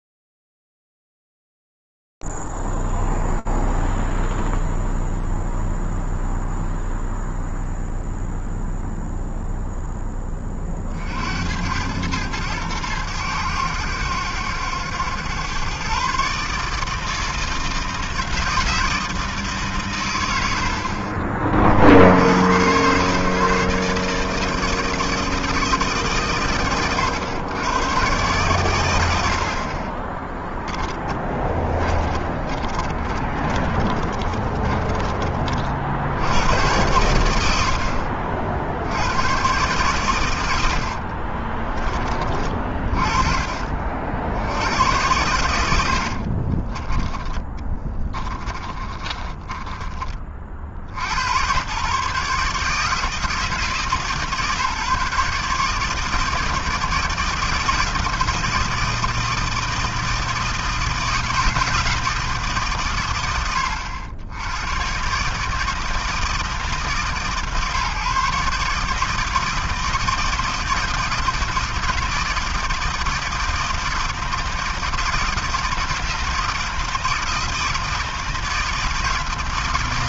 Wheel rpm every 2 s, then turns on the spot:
0, 0, 0, 0, 0, 50, 100, 100, 150, 160, 40, 130, 160, 100, 80, 20, 20, 40, 100, 130, 40, 50, 100, 10, 20, 120, 160, 150, 160, 160, 160, 70, 150, 150, 160, 160, 160, 160, 160, 160.
30-34 40-42 46-50